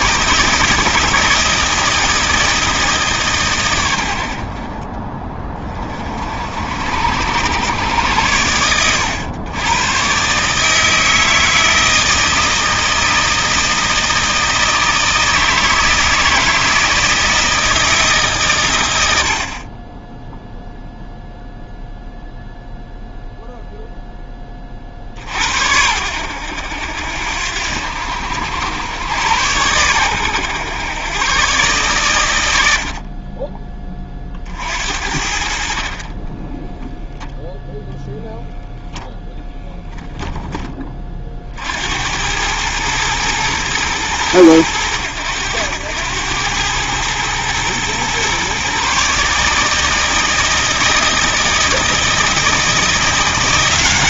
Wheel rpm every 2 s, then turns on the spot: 160, 160, 50, 60, 100, 150, 160, 160, 160, 130, 0, 0, 20, 80, 90, 110, 80, 50, 10, 0, 20, 110, 100, 110, 130, 160, 160.
36-38